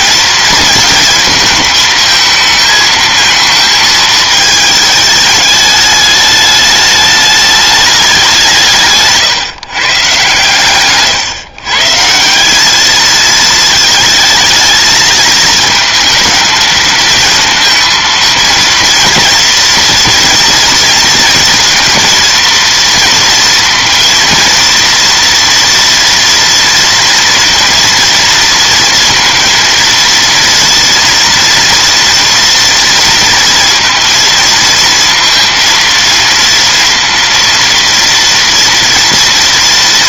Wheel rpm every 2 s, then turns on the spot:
230, 220, 220, 210, 170, 120, 190, 220, 220, 230, 230, 230, 230, 230, 230, 230, 230, 230, 230, 230.
none